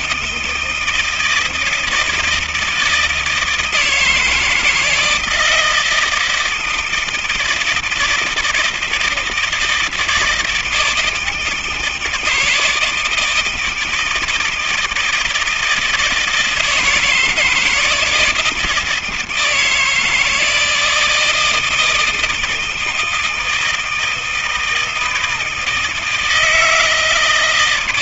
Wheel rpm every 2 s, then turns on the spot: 160, 160, 160, 160, 170, 160, 160, 160, 160, 160, 160, 160, 160, 160.
none